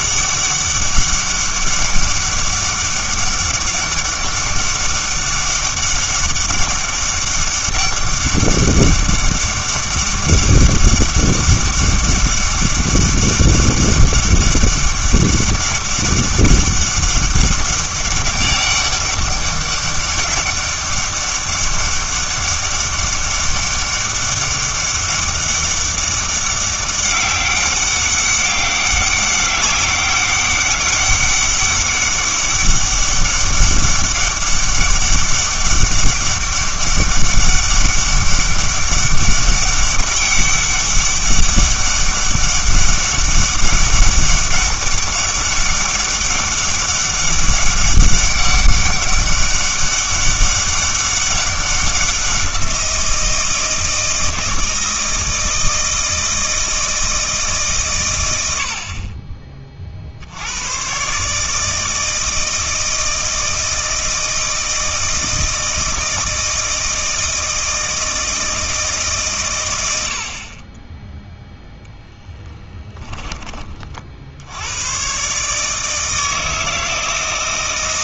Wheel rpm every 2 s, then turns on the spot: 200, 200, 200, 200, 200, 200, 200, 200, 200, 200, 200, 200, 200, 200, 200, 200, 200, 200, 200, 200, 200, 200, 200, 200, 200, 200, 180, 160, 160, 70, 110, 160, 160, 160, 160, 30, 10, 100, 160.
72-74